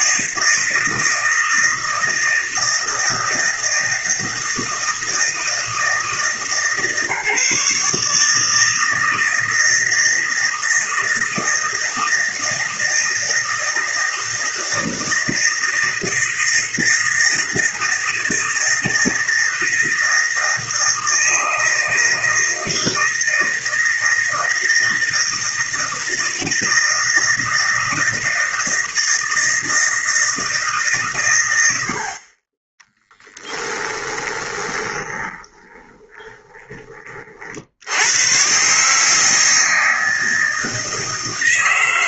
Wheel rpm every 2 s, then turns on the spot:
160, 160, 160, 150, 160, 160, 160, 160, 160, 160, 160, 160, 160, 160, 160, 150, 20, 20, 20, 140, 160.
34-36